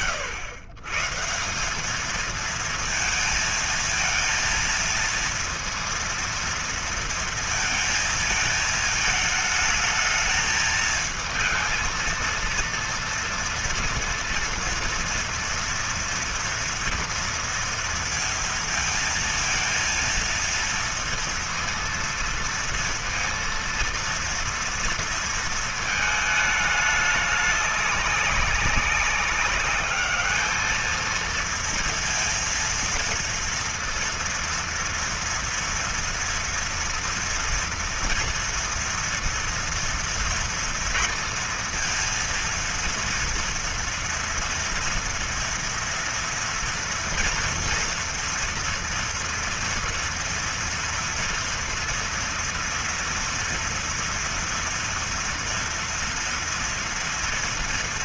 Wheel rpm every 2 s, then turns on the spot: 120, 230, 230, 230, 220, 220, 230, 230, 230, 230, 230, 230, 230, 210, 200, 230, 230, 230, 230, 240, 230, 230, 230, 230, 230, 230, 230, 230, 230.
none